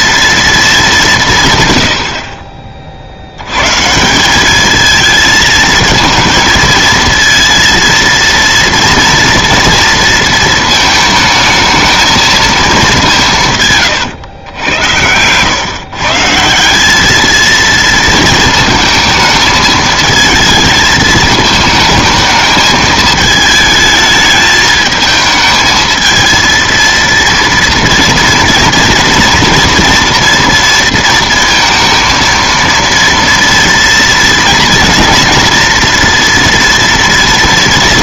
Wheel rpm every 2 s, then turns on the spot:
220, 40, 210, 220, 230, 220, 200, 100, 190, 220, 220, 220, 220, 230, 230, 230, 230, 230, 230.
none